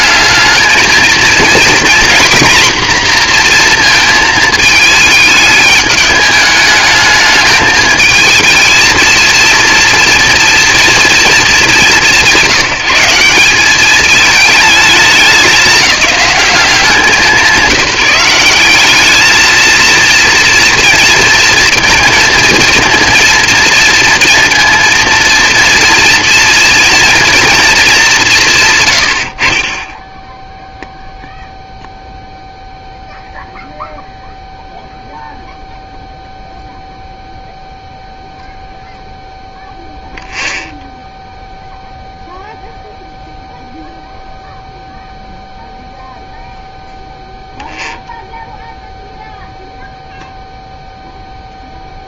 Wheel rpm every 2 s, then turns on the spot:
220, 230, 210, 220, 230, 230, 180, 210, 190, 200, 230, 230, 230, 230, 100, 0, 0, 0, 0, 0, 0, 0, 0, 0, 0, 0.
none